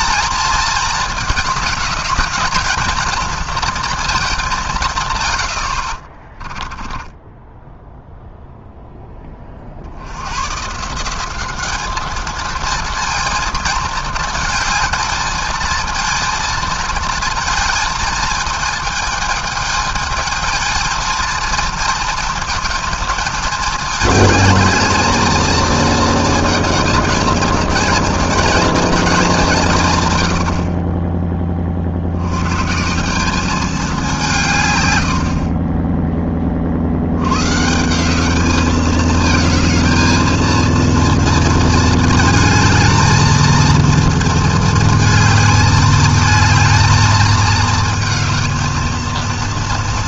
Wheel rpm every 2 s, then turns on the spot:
220, 220, 190, 20, 0, 110, 230, 230, 230, 220, 220, 230, 220, 230, 240, 60, 110, 150, 40, 210, 230, 220, 230, 220, 220.
6-8